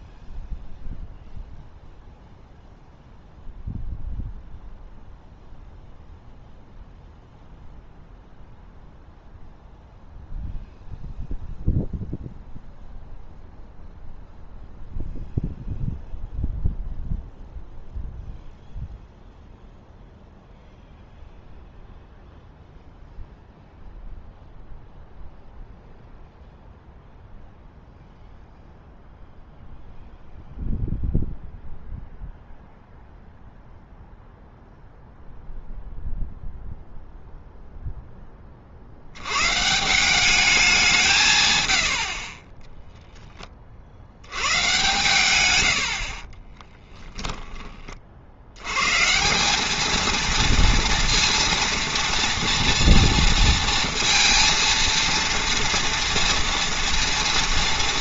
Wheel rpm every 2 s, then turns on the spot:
0, 0, 0, 0, 0, 0, 0, 0, 0, 0, 0, 0, 0, 0, 0, 0, 0, 0, 0, 30, 200, 20, 120, 10, 90, 230, 230, 230, 230.
46-48